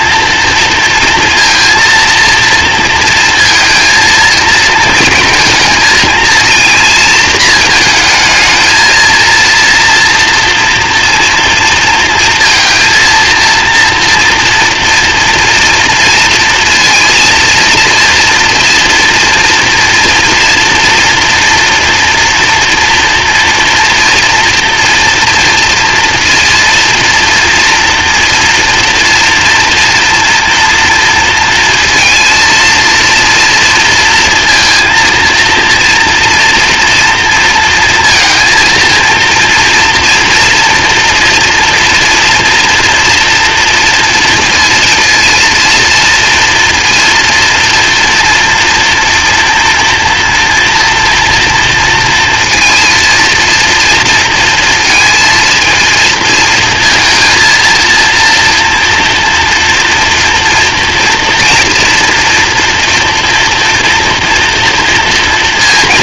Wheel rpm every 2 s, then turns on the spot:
230, 230, 230, 230, 230, 230, 230, 230, 230, 230, 230, 230, 230, 230, 240, 230, 230, 230, 240, 230, 240, 230, 230, 230, 230, 230, 230, 230, 220, 230, 230, 230, 230.
none